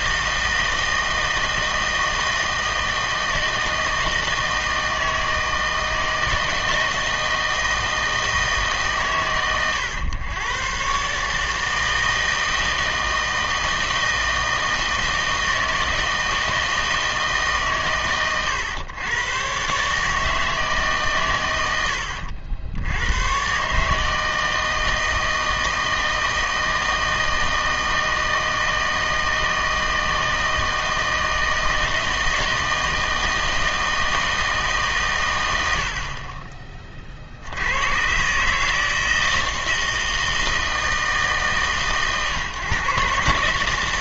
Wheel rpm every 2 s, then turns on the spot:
160, 160, 160, 160, 150, 120, 160, 160, 160, 110, 160, 80, 160, 160, 160, 160, 160, 150, 30, 150, 160, 140.
none